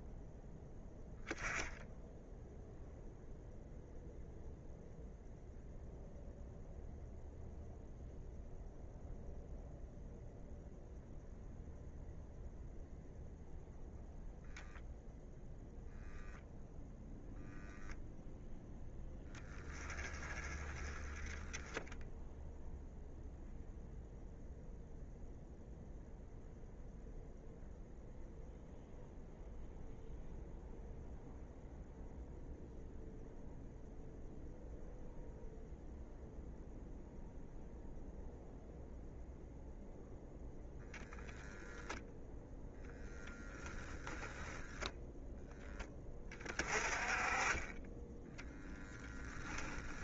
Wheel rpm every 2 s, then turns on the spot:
10, 0, 0, 0, 0, 0, 0, 0, 0, 0, 10, 0, 0, 0, 0, 0, 0, 0, 0, 0, 0, 0, 0, 20, 10.
none